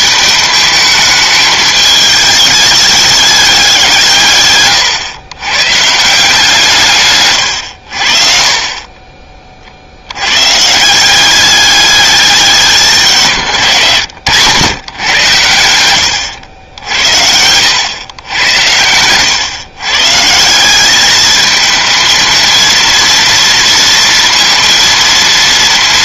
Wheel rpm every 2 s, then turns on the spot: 210, 210, 120, 150, 40, 140, 200, 120, 80, 100, 180, 230, 230.
4-6 8-10 16-18